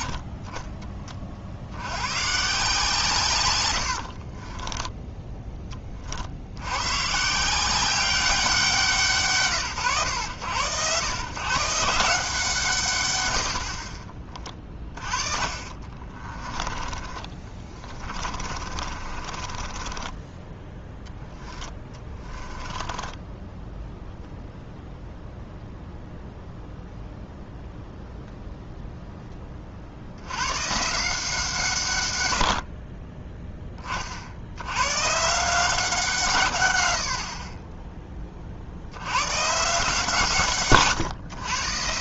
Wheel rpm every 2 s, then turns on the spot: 30, 150, 20, 110, 170, 110, 140, 30, 20, 30, 10, 10, 0, 0, 0, 140, 40, 100, 110, 80, 130.
4-6 16-20 22-24